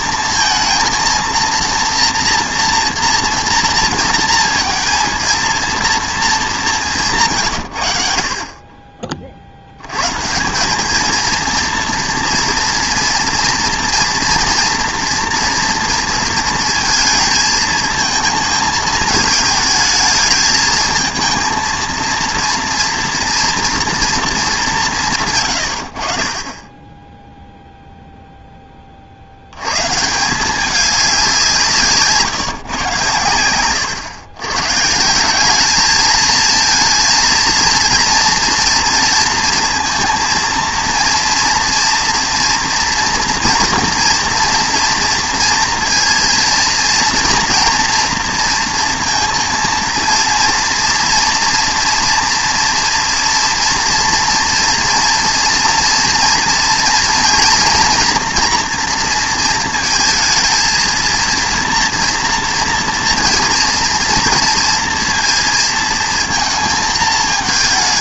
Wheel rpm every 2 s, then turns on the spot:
230, 230, 230, 180, 40, 200, 230, 240, 220, 220, 220, 230, 180, 10, 30, 190, 120, 150, 230, 230, 240, 230, 230, 230, 230, 230, 230, 230, 230, 230, 230, 230, 230, 220.
none